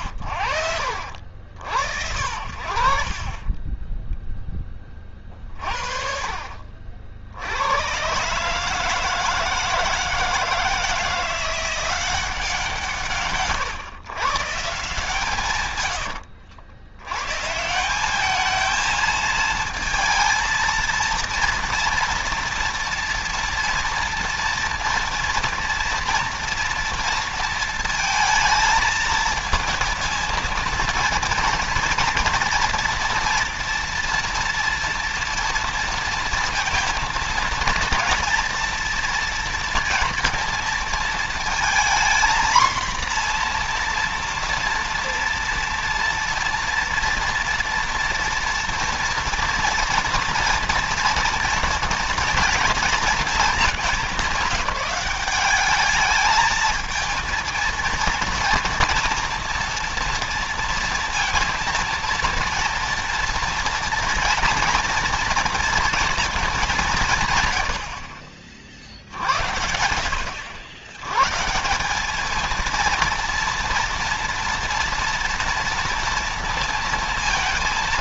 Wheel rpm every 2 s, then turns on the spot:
80, 70, 10, 40, 140, 160, 170, 150, 70, 200, 230, 230, 230, 230, 220, 230, 230, 230, 230, 230, 230, 240, 230, 240, 230, 230, 220, 190, 220, 230, 230, 230, 230, 210, 60, 90, 220, 240, 230.
none